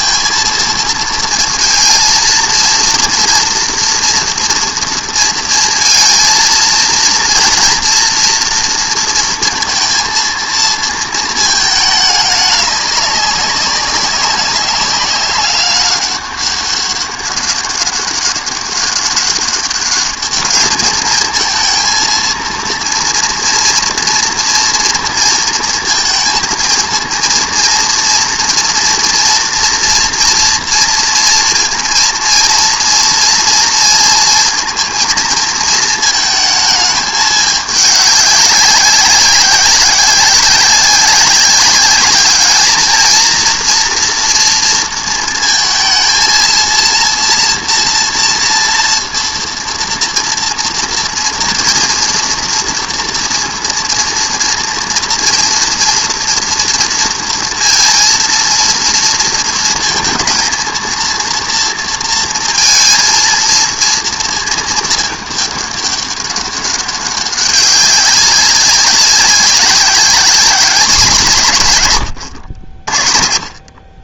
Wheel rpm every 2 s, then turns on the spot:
230, 230, 230, 230, 230, 230, 210, 190, 200, 200, 210, 230, 240, 230, 230, 230, 230, 230, 220, 200, 190, 210, 230, 240, 230, 230, 230, 230, 230, 230, 230, 230, 220, 200, 200, 190, 70.
none